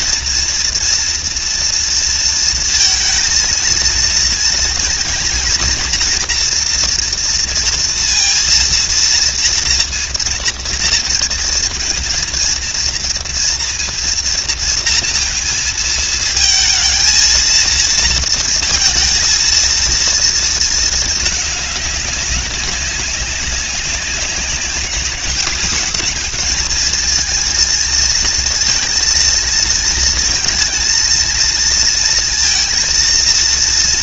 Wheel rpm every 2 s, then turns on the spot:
230, 220, 230, 230, 230, 230, 230, 230, 220, 230, 220, 190, 210, 230, 230, 230, 230.
none